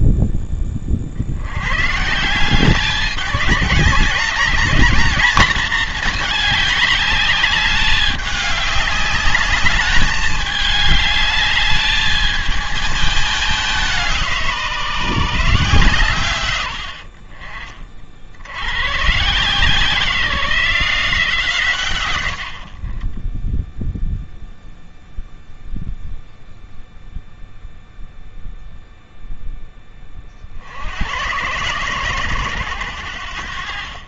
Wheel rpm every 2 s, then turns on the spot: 10, 170, 200, 210, 200, 210, 220, 170, 110, 90, 170, 60, 0, 0, 0, 70, 100.
none